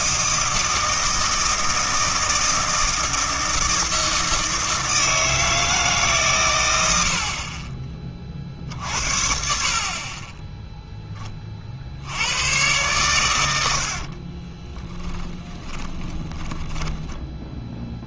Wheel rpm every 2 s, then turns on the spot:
160, 160, 160, 80, 50, 0, 110, 20, 20.
14-18